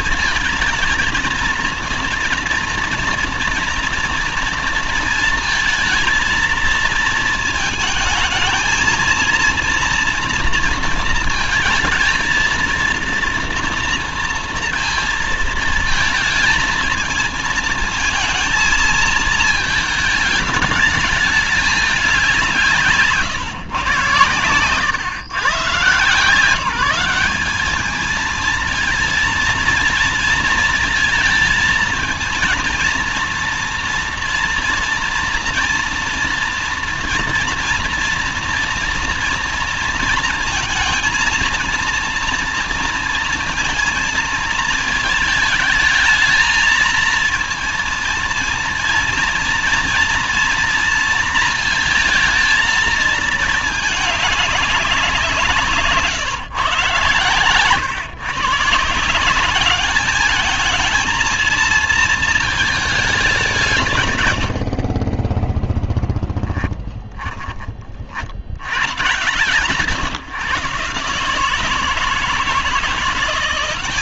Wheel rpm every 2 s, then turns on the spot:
230, 230, 230, 220, 230, 230, 230, 230, 220, 220, 210, 160, 130, 190, 230, 220, 230, 230, 230, 230, 230, 230, 220, 230, 230, 230, 220, 180, 110, 160, 220, 210, 40, 20, 110, 150, 180.
none